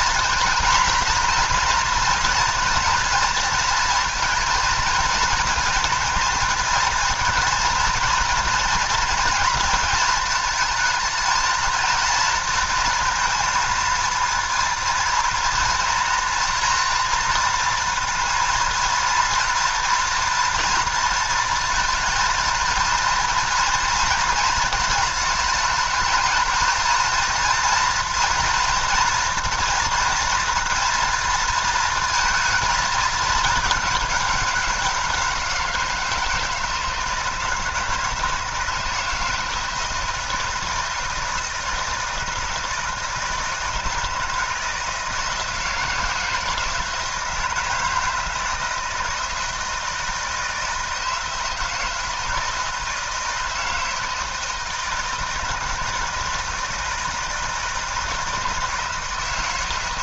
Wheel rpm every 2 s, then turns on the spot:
240, 240, 230, 230, 230, 220, 230, 230, 230, 230, 230, 230, 230, 220, 230, 240, 220, 190, 160, 160, 160, 160, 160, 160, 160, 160, 160, 160, 160, 160.
none